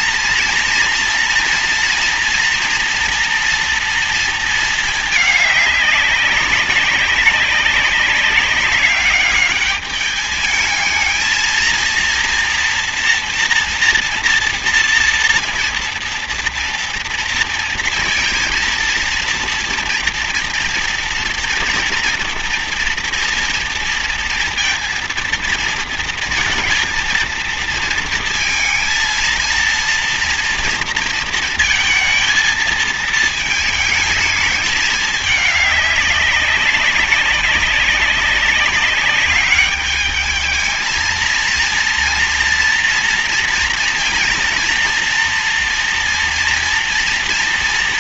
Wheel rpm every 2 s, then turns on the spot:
230, 230, 220, 190, 200, 220, 230, 230, 230, 230, 230, 230, 230, 230, 230, 230, 220, 210, 190, 200, 220, 230, 230, 240.
none